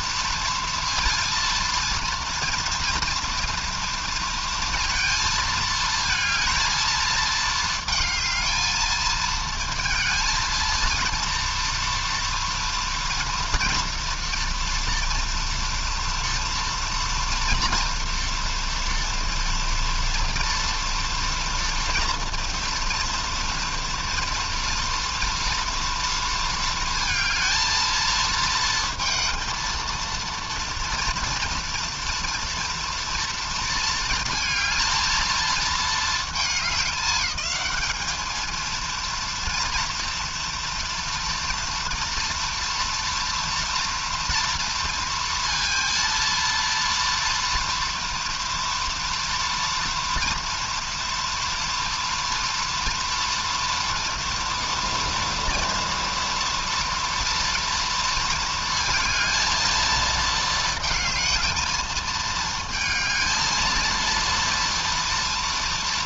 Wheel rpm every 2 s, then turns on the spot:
230, 230, 230, 220, 220, 230, 230, 230, 230, 240, 230, 230, 230, 230, 230, 230, 230, 220, 210, 220, 230, 230, 230, 230, 230, 230, 230, 230, 230, 230, 220, 220, 230.
none